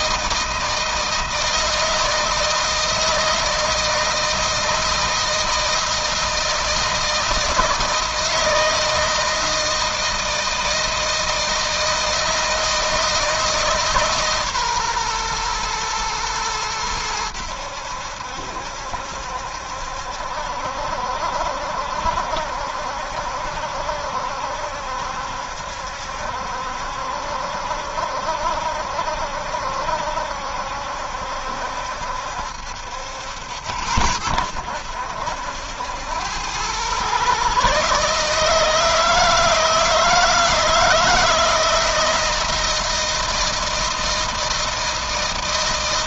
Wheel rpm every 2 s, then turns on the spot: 160, 160, 160, 160, 160, 160, 160, 130, 110, 70, 70, 70, 70, 70, 70, 70, 70, 80, 110, 160, 160, 160, 160.
none